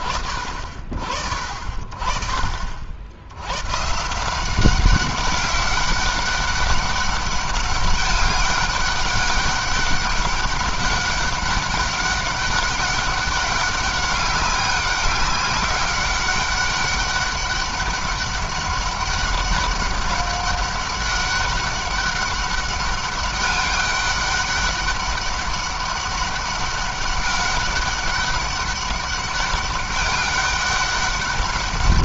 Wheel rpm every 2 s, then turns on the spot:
60, 70, 190, 200, 200, 200, 200, 200, 200, 200, 200, 200, 200, 200, 200, 200.
none